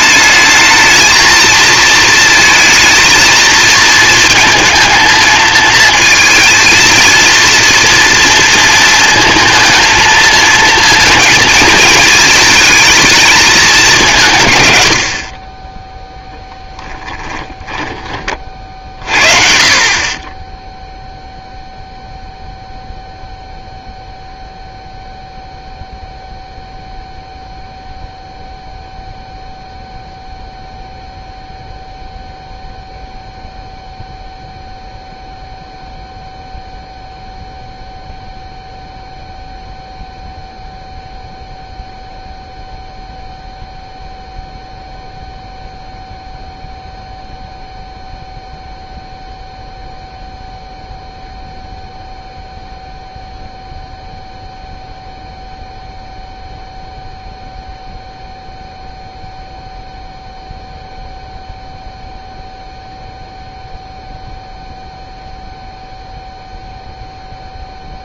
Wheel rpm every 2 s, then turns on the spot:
220, 220, 230, 230, 220, 230, 220, 110, 0, 40, 0, 0, 0, 0, 0, 0, 0, 0, 0, 0, 0, 0, 0, 0, 0, 0, 0, 0, 0, 0, 0, 0, 0, 0.
none